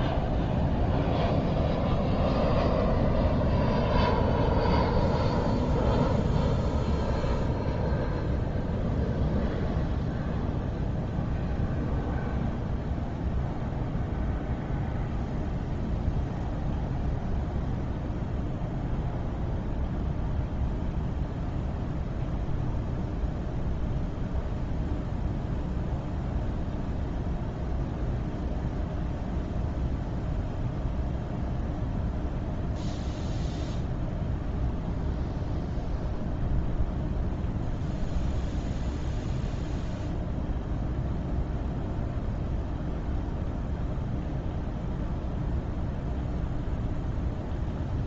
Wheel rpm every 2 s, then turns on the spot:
0, 0, 0, 0, 0, 0, 0, 0, 0, 0, 0, 0, 0, 0, 0, 0, 0, 0, 0, 0, 0, 0, 0, 0.
none